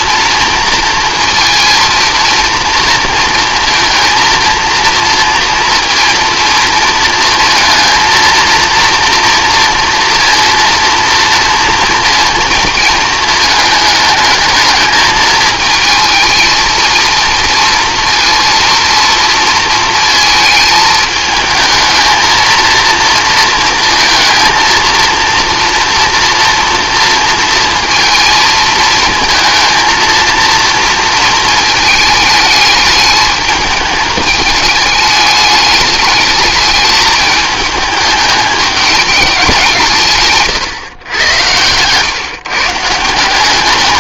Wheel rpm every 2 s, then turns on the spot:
230, 230, 230, 230, 230, 230, 230, 220, 220, 230, 220, 220, 230, 230, 220, 230, 220, 220, 210, 210, 150, 140.
40-42